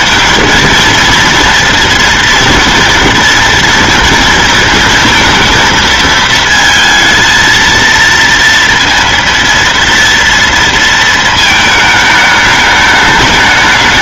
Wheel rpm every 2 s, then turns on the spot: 230, 230, 230, 220, 230, 230, 210.
none